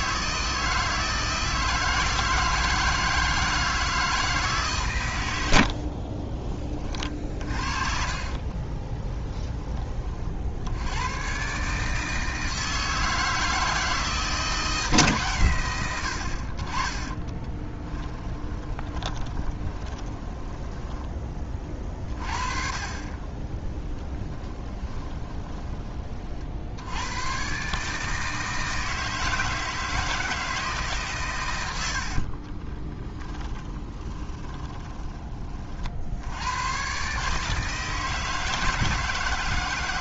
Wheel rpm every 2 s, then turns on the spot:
160, 160, 140, 30, 30, 80, 160, 160, 30, 20, 10, 40, 10, 70, 160, 150, 20, 20, 110, 160.
8-10 18-22 24-26 32-36